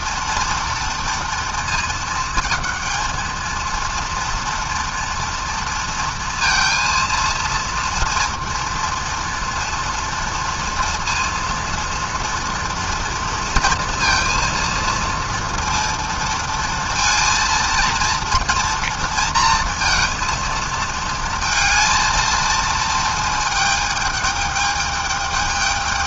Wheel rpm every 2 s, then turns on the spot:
230, 220, 240, 230, 230, 230, 230, 220, 230, 230, 230, 230, 210.
none